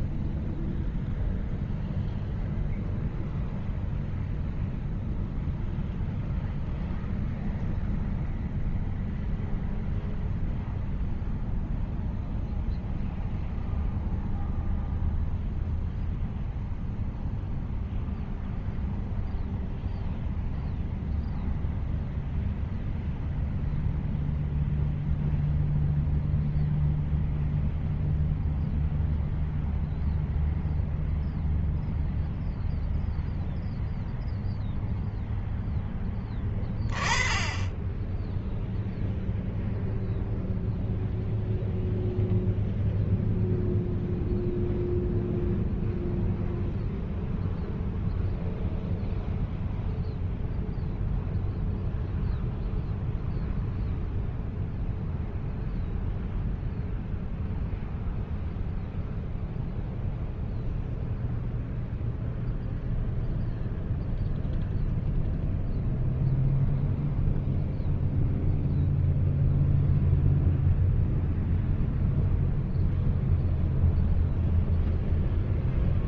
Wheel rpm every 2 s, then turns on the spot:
0, 0, 0, 0, 0, 0, 0, 0, 0, 0, 0, 0, 0, 0, 0, 0, 0, 0, 20, 0, 0, 0, 0, 0, 0, 0, 0, 0, 0, 0, 0, 0, 0, 0, 0, 0, 0, 0.
none